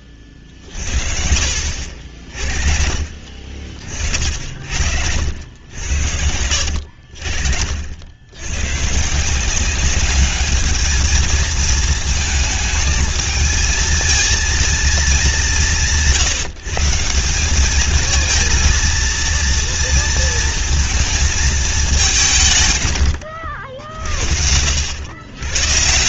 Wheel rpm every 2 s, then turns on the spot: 50, 50, 60, 70, 110, 210, 220, 230, 160, 230, 230, 140, 80.
none